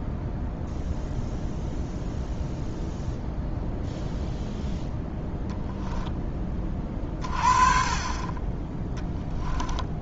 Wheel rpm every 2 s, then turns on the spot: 0, 0, 0, 30, 10.
none